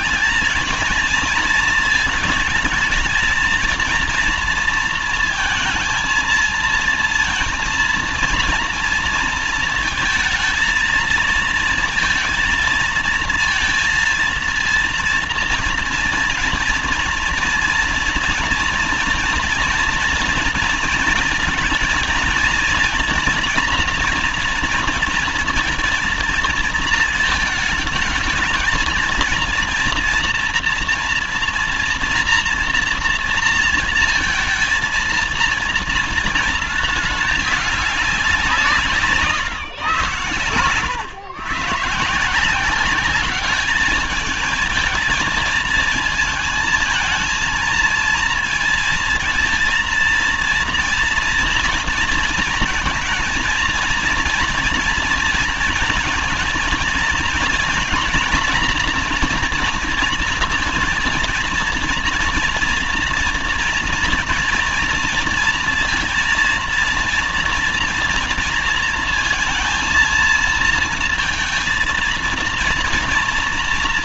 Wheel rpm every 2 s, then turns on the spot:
210, 220, 230, 230, 230, 230, 230, 230, 230, 240, 230, 230, 230, 230, 220, 230, 240, 230, 230, 180, 110, 170, 220, 220, 230, 230, 230, 240, 230, 240, 230, 230, 230, 230, 230, 220, 230.
none